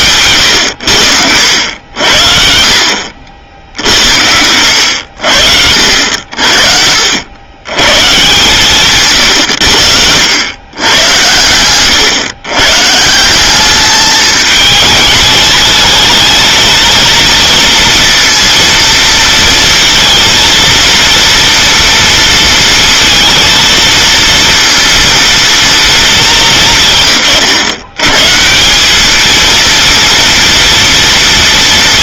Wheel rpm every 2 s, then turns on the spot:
100, 70, 90, 60, 140, 100, 140, 210, 220, 230, 230, 230, 230, 180, 180, 230.
none